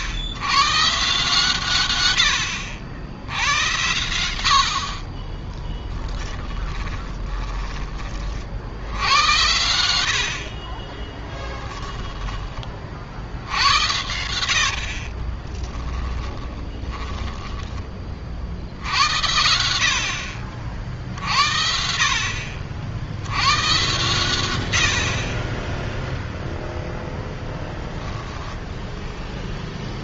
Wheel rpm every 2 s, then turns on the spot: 120, 90, 60, 20, 80, 40, 40, 50, 10, 80, 60, 70, 80, 0, 0.
4-8 10-12 14-18